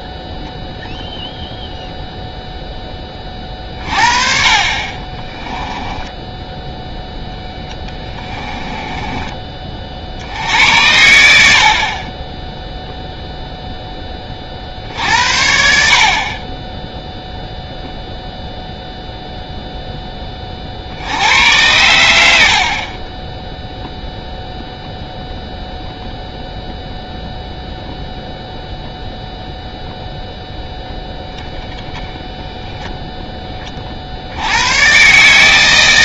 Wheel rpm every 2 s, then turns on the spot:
0, 0, 30, 10, 20, 70, 20, 40, 30, 0, 30, 70, 0, 0, 0, 0, 0, 70.
8-10